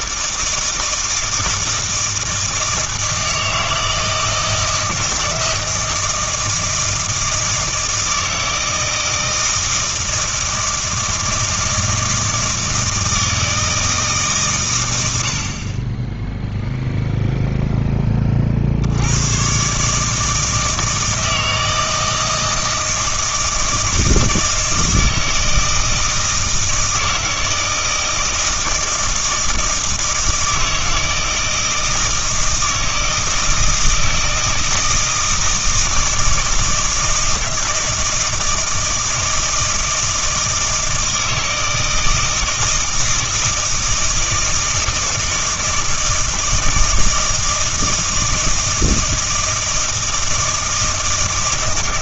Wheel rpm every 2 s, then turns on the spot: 160, 160, 170, 160, 160, 160, 160, 110, 0, 80, 160, 160, 160, 160, 160, 160, 160, 160, 160, 160, 160, 160, 160, 160, 160, 160.
none